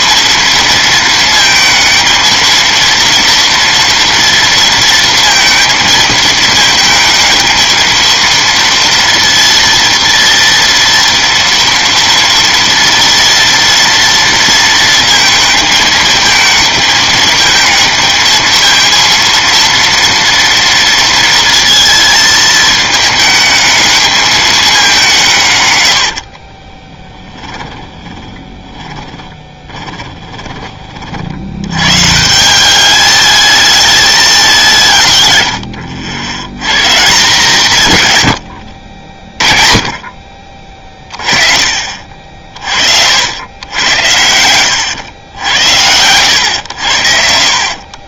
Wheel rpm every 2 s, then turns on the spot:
230, 230, 230, 220, 230, 230, 230, 230, 220, 230, 230, 220, 200, 30, 20, 30, 180, 190, 120, 80, 40, 50, 90, 90.
26-30